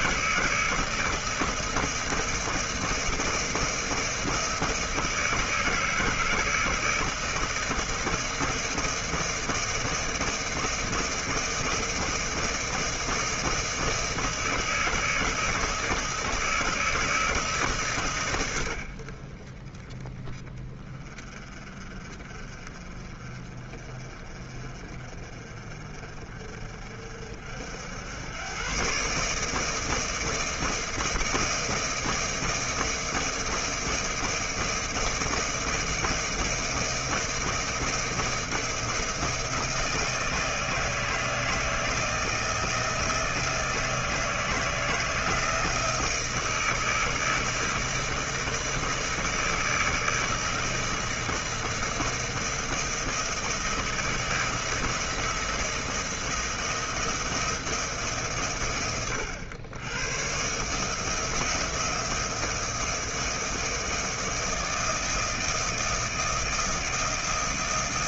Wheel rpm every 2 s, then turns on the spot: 160, 160, 160, 160, 160, 160, 160, 160, 160, 100, 20, 40, 40, 50, 110, 160, 160, 160, 160, 170, 160, 160, 160, 160, 160, 160, 160, 160, 160, 100, 130, 160, 160, 160.
none